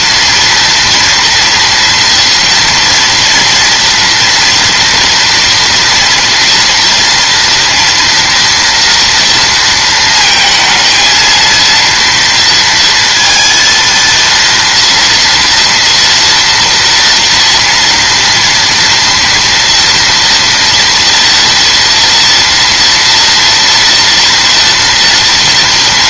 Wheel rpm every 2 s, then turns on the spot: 230, 230, 230, 230, 230, 220, 230, 230, 230, 230, 230, 240, 230.
none